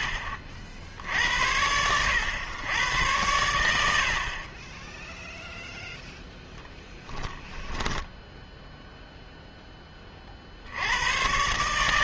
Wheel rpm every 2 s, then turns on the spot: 60, 100, 20, 0, 0, 70.
none